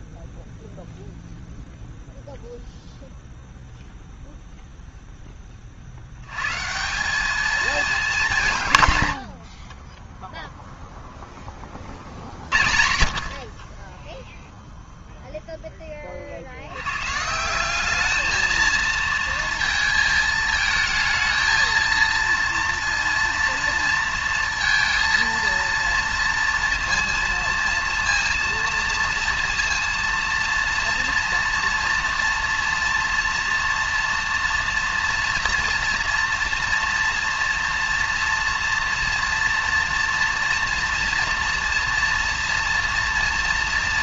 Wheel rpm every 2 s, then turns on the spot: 10, 0, 0, 160, 140, 10, 60, 10, 180, 220, 220, 230, 230, 230, 230, 240, 230, 230, 230, 240, 240, 230.
none